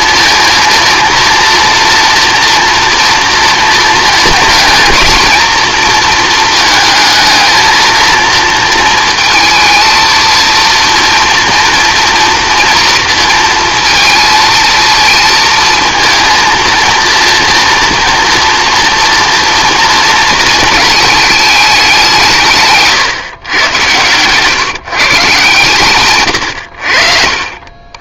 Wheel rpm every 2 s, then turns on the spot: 230, 230, 230, 220, 230, 230, 230, 230, 230, 230, 220, 170, 150, 80.
22-24